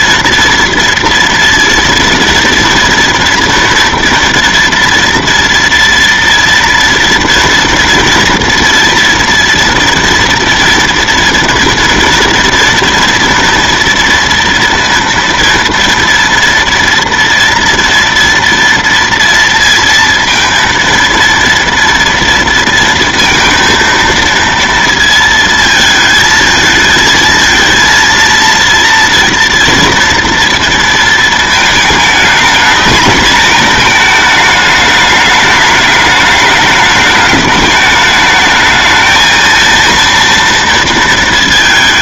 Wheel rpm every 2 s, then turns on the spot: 230, 230, 240, 230, 230, 230, 230, 230, 230, 230, 230, 230, 230, 220, 230, 230, 220, 210, 210, 220, 230.
none